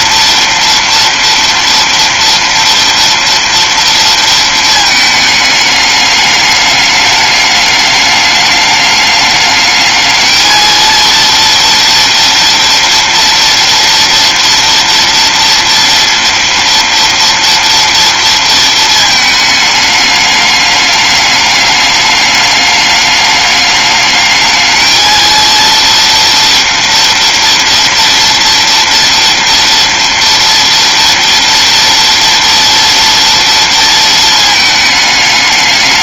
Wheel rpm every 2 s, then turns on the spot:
230, 230, 220, 210, 210, 230, 230, 230, 230, 220, 210, 210, 230, 230, 230, 240, 230, 210.
none